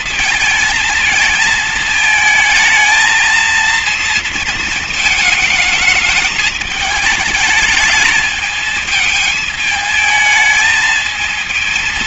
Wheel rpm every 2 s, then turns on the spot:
230, 220, 220, 210, 220, 220.
none